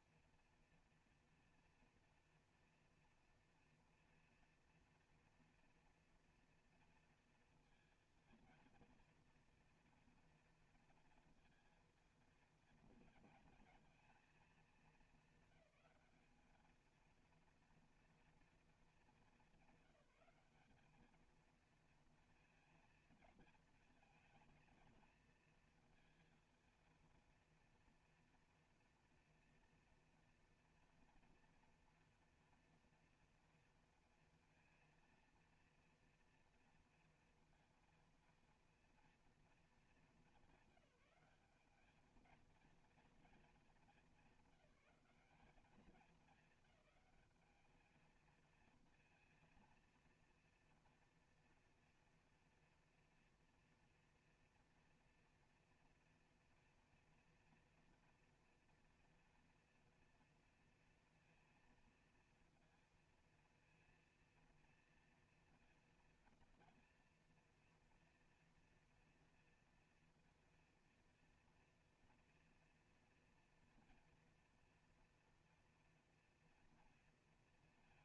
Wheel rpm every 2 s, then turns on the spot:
240, 230, 230, 230, 230, 230, 230, 220, 220, 220, 200, 230, 230, 230, 230, 230, 230, 230, 230, 230, 200, 230, 200, 210, 230, 230, 230, 230, 230, 230, 230, 230, 230, 230, 240, 230, 230, 230, 230.
none